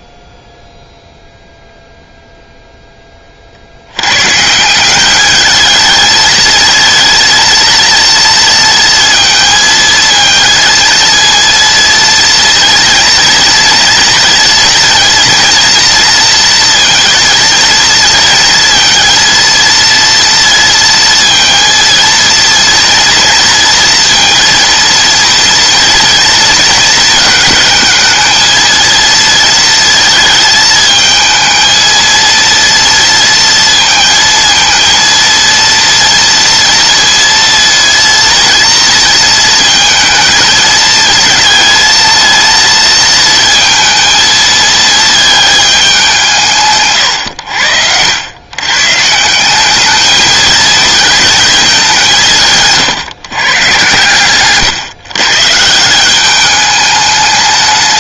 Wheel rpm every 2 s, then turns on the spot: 10, 0, 170, 220, 230, 230, 230, 230, 230, 230, 230, 230, 230, 220, 230, 220, 230, 230, 230, 230, 220, 230, 220, 140, 140, 230, 150, 130, 210.
46-48